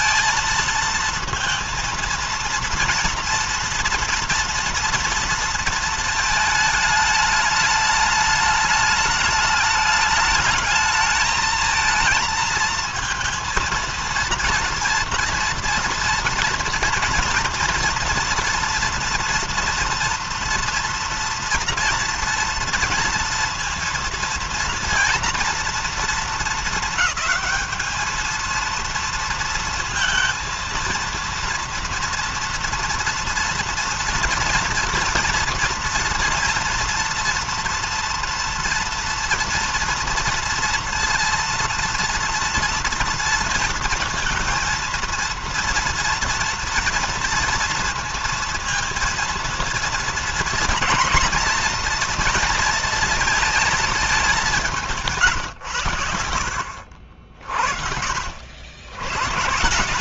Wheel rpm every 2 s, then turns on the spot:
230, 230, 230, 220, 210, 210, 230, 230, 230, 230, 230, 230, 230, 220, 230, 230, 230, 230, 230, 230, 230, 230, 230, 230, 230, 230, 230, 190, 70, 90.
56-58